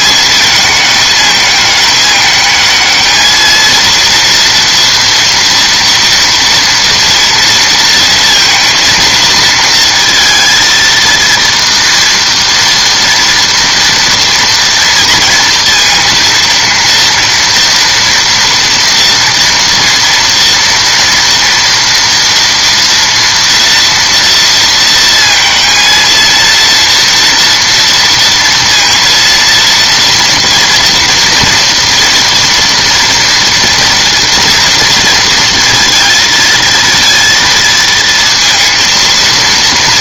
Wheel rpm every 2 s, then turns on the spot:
210, 220, 240, 230, 230, 230, 230, 230, 230, 230, 230, 230, 230, 230, 230, 230, 230, 230, 230, 230.
none